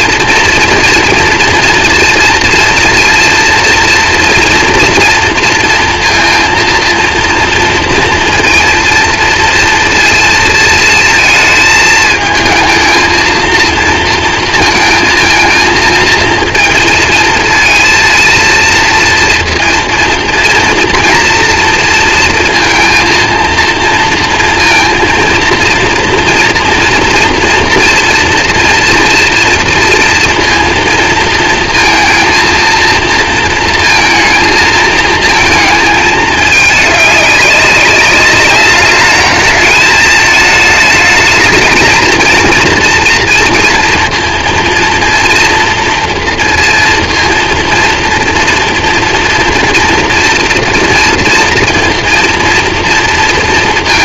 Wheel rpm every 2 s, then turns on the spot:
230, 230, 240, 230, 230, 230, 220, 230, 230, 230, 240, 230, 230, 240, 230, 230, 230, 230, 210, 210, 220, 230, 230, 230, 230, 240, 230.
none